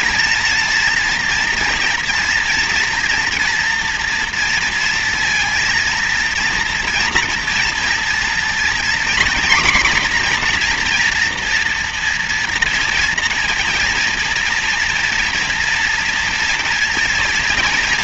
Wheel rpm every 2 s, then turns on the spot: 230, 230, 230, 230, 240, 240, 230, 230, 230.
none